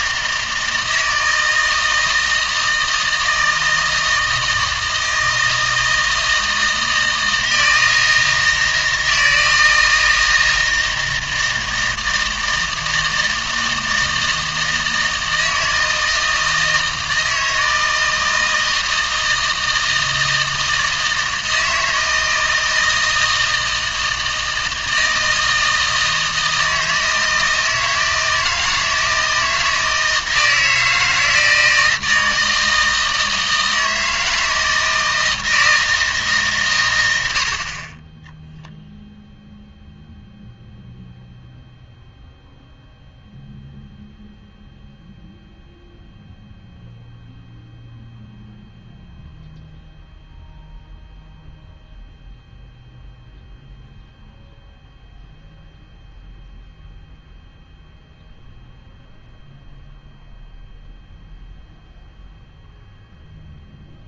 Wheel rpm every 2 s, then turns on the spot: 160, 160, 160, 160, 160, 160, 160, 160, 160, 160, 160, 160, 160, 160, 160, 160, 160, 160, 120, 0, 0, 0, 0, 0, 0, 0, 0, 0, 0, 0, 0, 0.
none